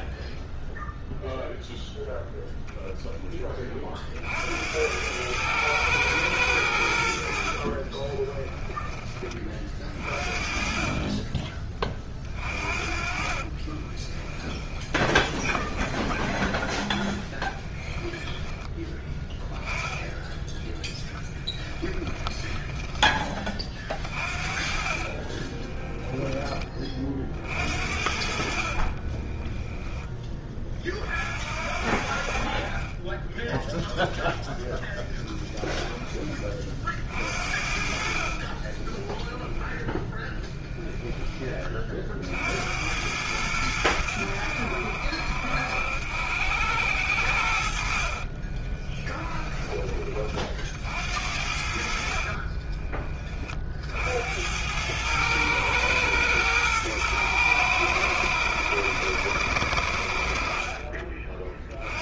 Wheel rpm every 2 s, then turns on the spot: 0, 0, 80, 90, 20, 40, 40, 20, 10, 10, 10, 10, 30, 20, 50, 30, 50, 0, 30, 40, 10, 70, 80, 80, 30, 50, 30, 90, 110, 100, 50.
12-16 22-26 28-30 38-42 48-50 52-54